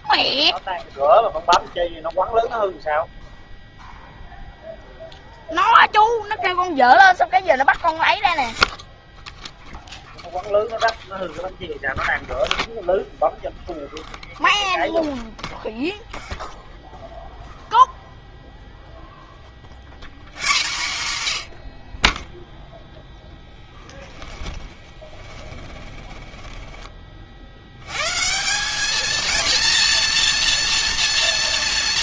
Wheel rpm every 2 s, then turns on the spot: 0, 0, 0, 0, 0, 0, 0, 0, 0, 0, 120, 0, 20, 10, 180, 230.
24-28